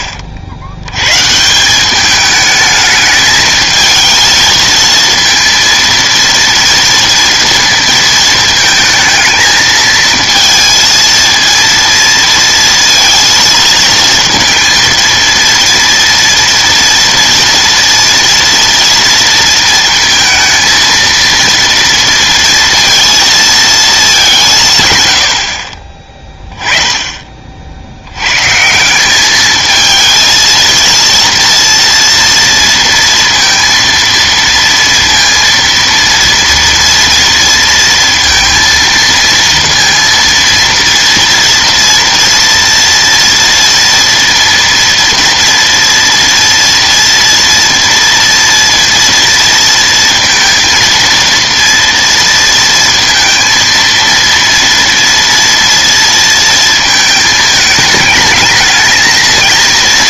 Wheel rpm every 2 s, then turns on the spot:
80, 210, 230, 230, 220, 230, 230, 230, 230, 230, 230, 230, 170, 10, 140, 230, 230, 230, 230, 230, 230, 230, 230, 230, 240, 230, 230, 230, 230, 220.
none